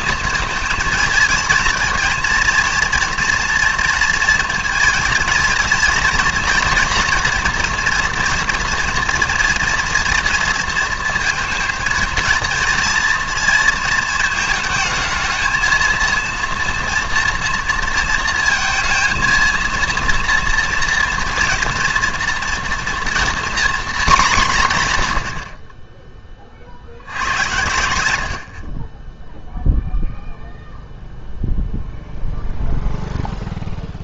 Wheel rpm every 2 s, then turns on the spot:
230, 230, 230, 240, 230, 230, 230, 220, 230, 220, 230, 240, 180, 40, 40, 0, 0.
none